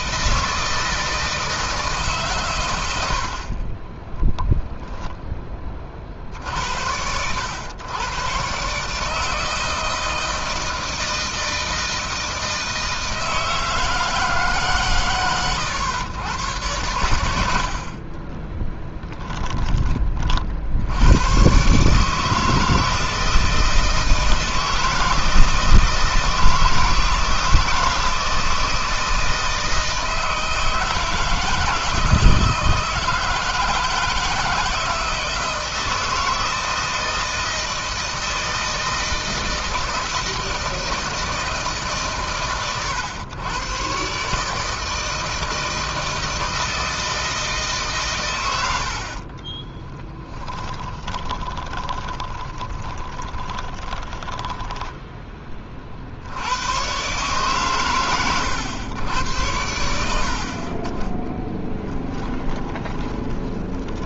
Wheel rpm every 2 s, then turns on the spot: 160, 130, 0, 60, 130, 160, 160, 140, 110, 20, 60, 160, 160, 160, 160, 160, 160, 160, 160, 170, 160, 120, 140, 160, 90, 10, 20, 10, 100, 100, 50, 20.
18-20 50-56 62-64